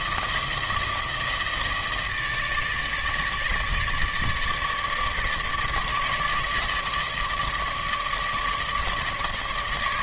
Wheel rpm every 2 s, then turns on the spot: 160, 150, 150, 150, 150.
none